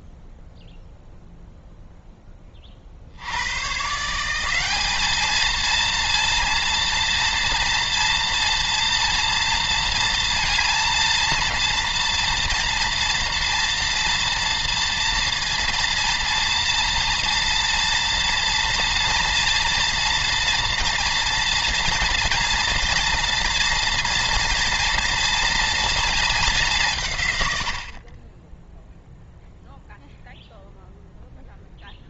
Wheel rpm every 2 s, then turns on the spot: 0, 30, 200, 230, 230, 230, 230, 230, 230, 230, 230, 230, 230, 190, 0, 0.
none